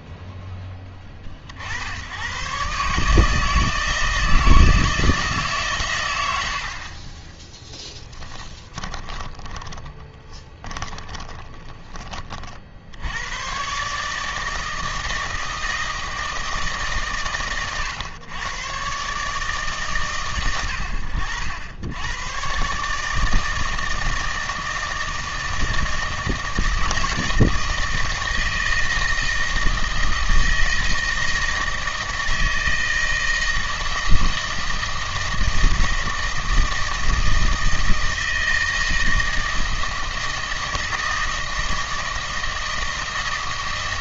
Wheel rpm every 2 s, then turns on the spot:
10, 130, 160, 70, 20, 20, 60, 160, 150, 120, 110, 130, 160, 160, 160, 160, 160, 160, 160, 160, 160, 160.
8-12